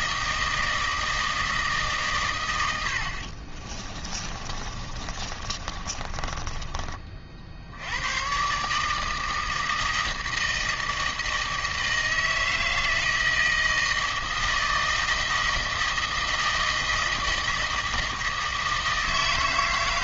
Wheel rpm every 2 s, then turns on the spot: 160, 90, 30, 30, 140, 160, 160, 160, 160, 160.
4-6